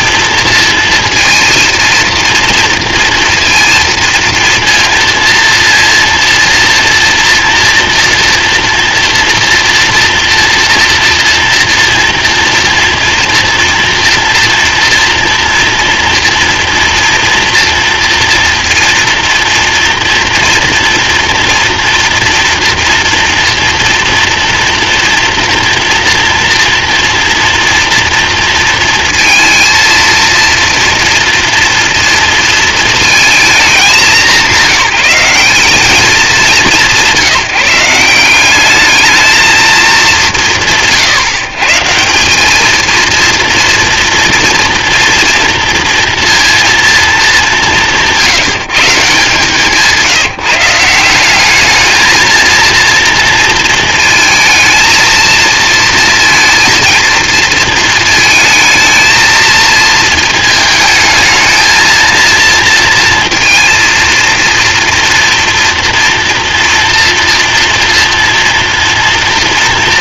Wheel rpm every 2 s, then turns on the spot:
230, 230, 230, 230, 230, 230, 230, 230, 230, 230, 230, 230, 230, 240, 230, 230, 220, 190, 190, 210, 120, 230, 240, 210, 170, 190, 230, 220, 230, 220, 220, 230, 230, 230, 230.
none